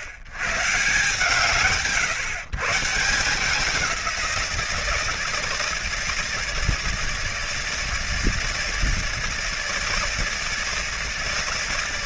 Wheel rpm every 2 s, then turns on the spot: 100, 130, 170, 160, 160, 160.
none